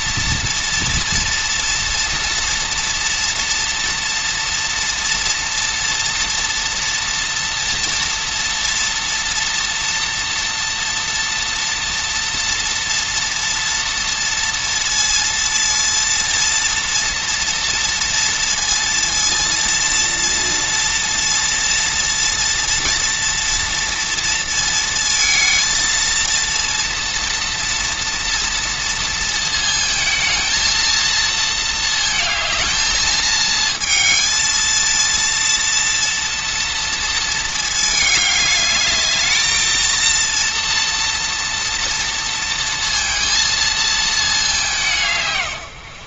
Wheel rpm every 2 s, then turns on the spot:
230, 230, 240, 230, 230, 230, 230, 230, 230, 230, 230, 230, 220, 230, 230, 230, 220, 230, 230, 210, 230, 230, 170.
none